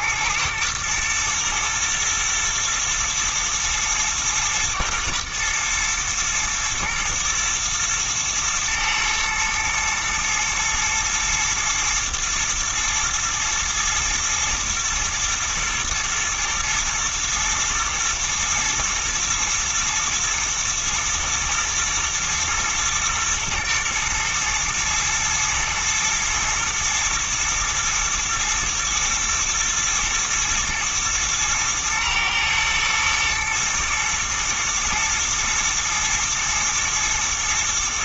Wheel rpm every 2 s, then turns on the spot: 110, 110, 120, 120, 110, 120, 120, 110, 110, 110, 120, 120, 110, 120, 120, 110, 110, 110, 110.
none